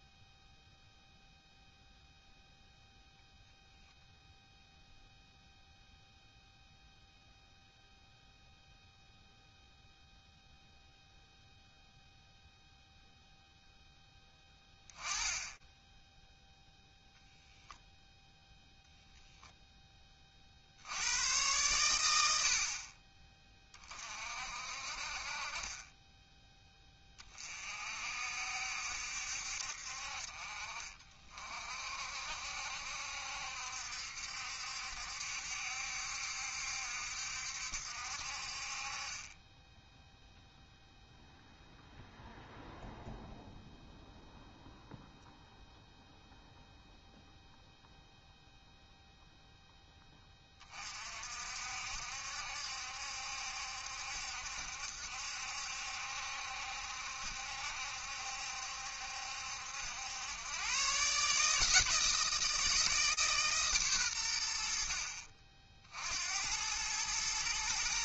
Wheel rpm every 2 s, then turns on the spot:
0, 0, 0, 0, 0, 0, 0, 10, 0, 10, 100, 30, 20, 50, 50, 50, 70, 70, 70, 10, 0, 0, 0, 0, 0, 50, 70, 70, 70, 70, 150, 150, 50, 110.
24-26